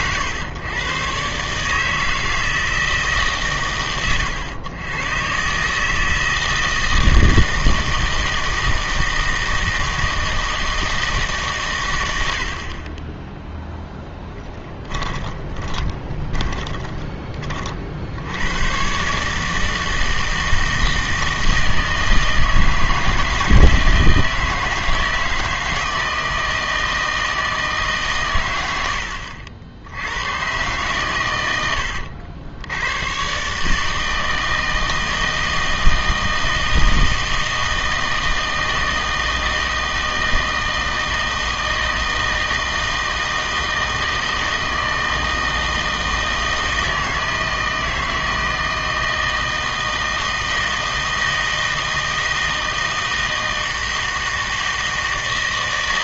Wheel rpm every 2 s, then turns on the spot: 120, 160, 100, 160, 160, 160, 50, 20, 20, 100, 160, 160, 160, 160, 110, 120, 90, 160, 160, 160, 160, 160, 160, 160, 160, 160, 160, 160.
14-18